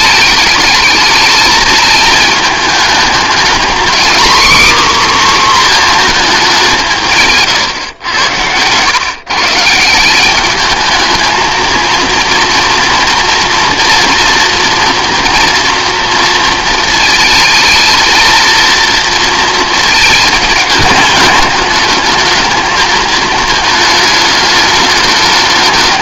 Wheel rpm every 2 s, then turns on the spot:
220, 210, 270, 170, 120, 210, 230, 230, 220, 230, 220, 220, 210.
none